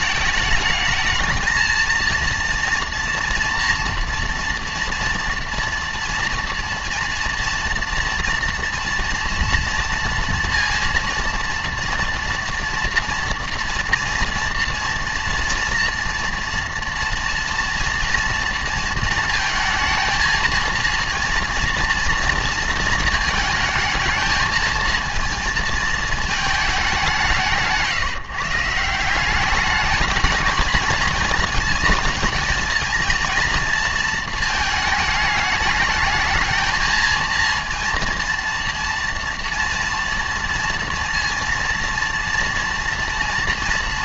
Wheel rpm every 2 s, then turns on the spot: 220, 230, 230, 230, 230, 230, 230, 230, 230, 230, 230, 230, 230, 170, 190, 220, 230, 210, 230, 230, 230, 230.
none